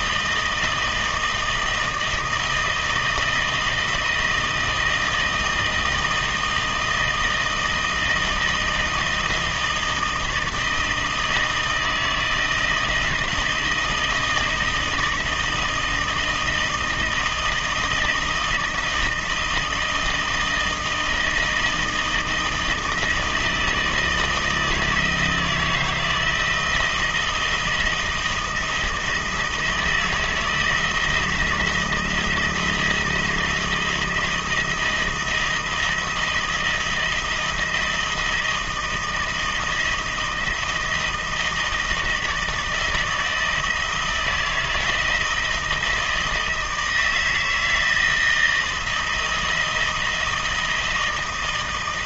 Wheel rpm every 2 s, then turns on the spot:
160, 160, 160, 160, 160, 160, 160, 160, 160, 160, 160, 160, 160, 160, 160, 170, 160, 170, 170, 160, 160, 160, 160, 160, 160, 160.
none